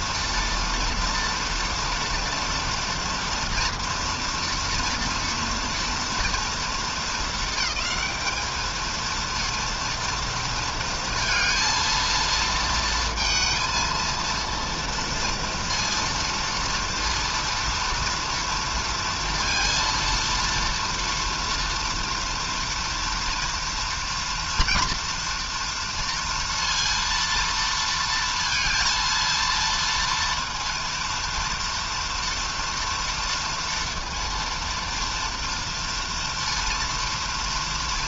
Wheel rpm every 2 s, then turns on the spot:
230, 230, 230, 230, 220, 230, 230, 230, 230, 230, 230, 230, 230, 230, 230, 230, 230, 230, 230.
none